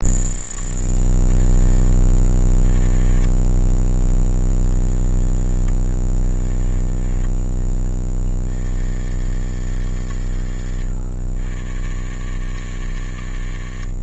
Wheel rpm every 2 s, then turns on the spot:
30, 20, 0, 0, 50, 50, 70.
none